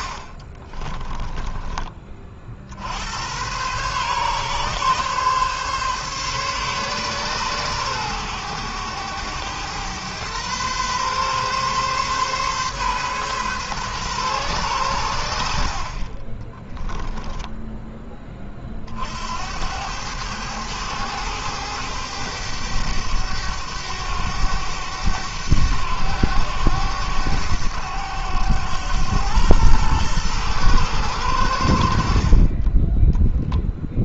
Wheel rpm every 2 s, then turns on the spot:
30, 70, 140, 140, 110, 120, 130, 120, 10, 40, 100, 100, 100, 100, 100, 110, 20.
0-2 16-18